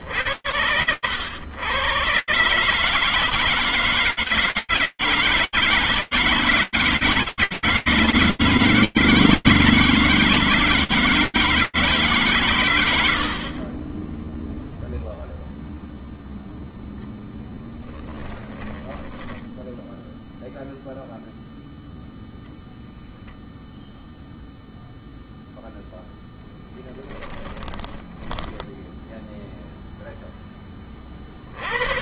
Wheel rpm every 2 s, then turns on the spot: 80, 130, 160, 160, 160, 160, 150, 20, 0, 10, 0, 0, 0, 10, 0, 30.
18-20 26-28